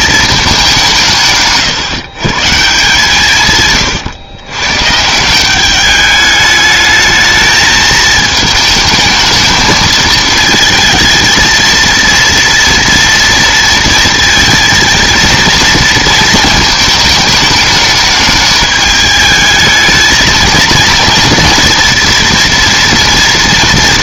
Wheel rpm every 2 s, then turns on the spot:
210, 150, 120, 210, 220, 220, 230, 230, 220, 210, 230, 240.
none